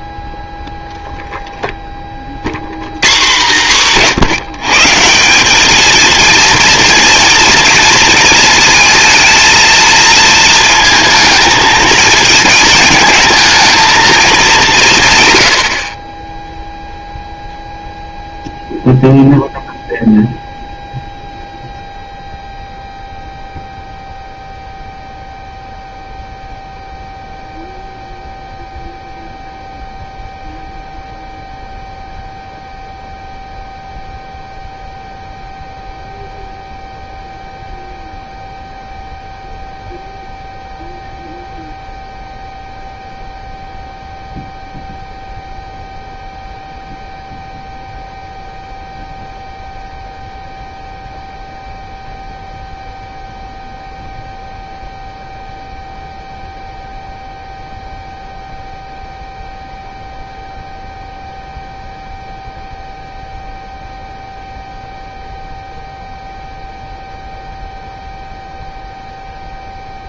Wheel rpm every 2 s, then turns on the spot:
0, 120, 160, 230, 230, 220, 220, 180, 0, 0, 0, 0, 0, 0, 0, 0, 0, 0, 0, 0, 0, 0, 0, 0, 0, 0, 0, 0, 0, 0, 0, 0, 0, 0, 0.
none